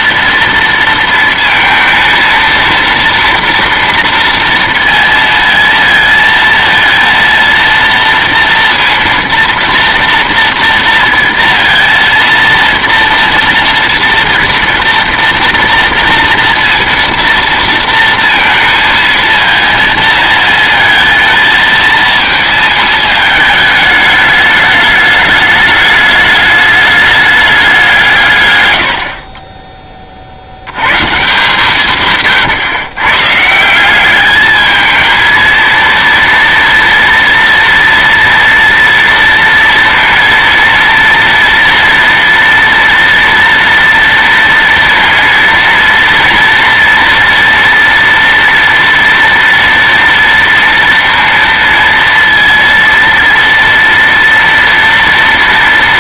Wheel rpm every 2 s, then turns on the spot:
230, 230, 230, 230, 230, 230, 230, 230, 230, 230, 230, 220, 210, 210, 100, 110, 120, 220, 230, 230, 230, 240, 230, 230, 230, 230, 230, 230.
none